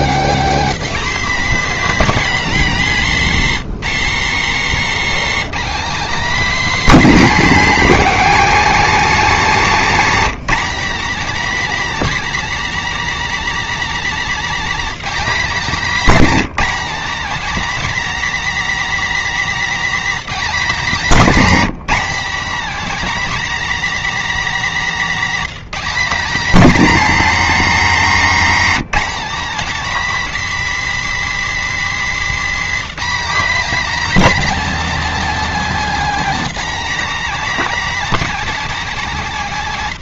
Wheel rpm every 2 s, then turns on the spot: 250, 230, 260, 260, 250, 260, 280, 240, 250, 280, 240, 280, 240, 270, 260, 290, 250, 270, 270, 240.
none